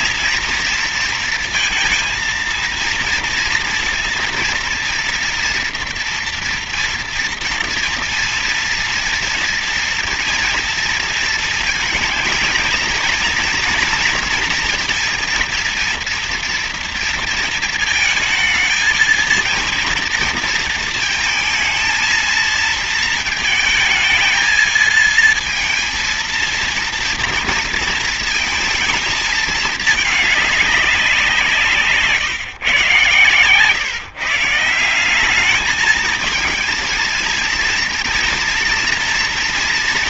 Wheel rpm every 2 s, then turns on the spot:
230, 230, 230, 230, 230, 230, 220, 230, 230, 220, 230, 230, 220, 230, 220, 210, 140, 170, 220, 230.
none